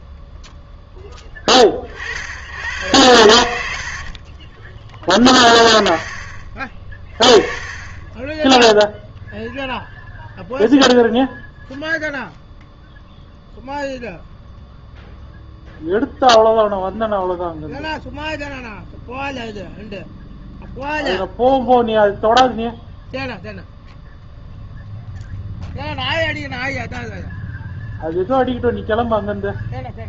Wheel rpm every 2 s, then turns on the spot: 10, 100, 20, 20, 0, 0, 0, 0, 0, 0, 0, 0, 0, 0, 0.
none